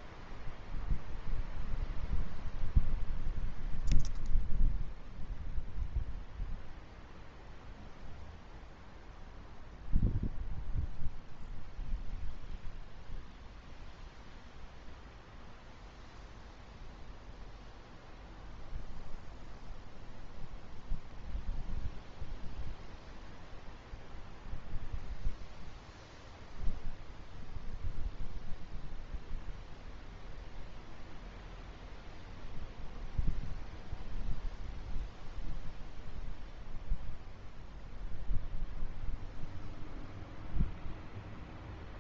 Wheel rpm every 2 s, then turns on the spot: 0, 0, 0, 0, 0, 0, 0, 0, 0, 0, 0, 0, 0, 0, 0, 0, 0, 0, 0, 0, 0.
none